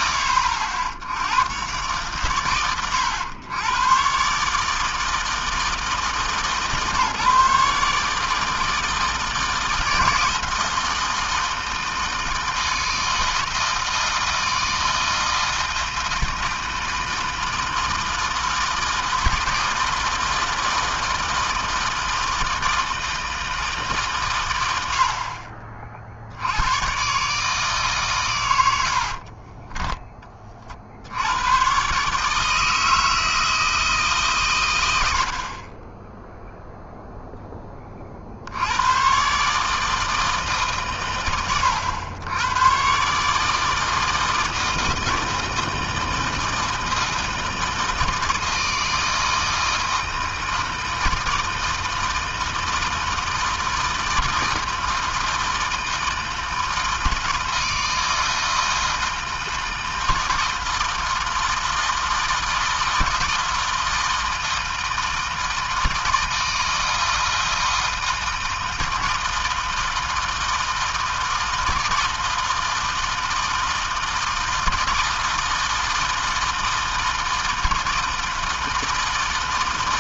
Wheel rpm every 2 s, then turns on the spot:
80, 110, 160, 150, 160, 160, 160, 160, 160, 160, 160, 160, 50, 140, 60, 80, 160, 80, 0, 120, 130, 140, 160, 160, 160, 160, 160, 160, 160, 160, 160, 160, 160, 160, 160, 160, 160, 160, 160, 160.
28-30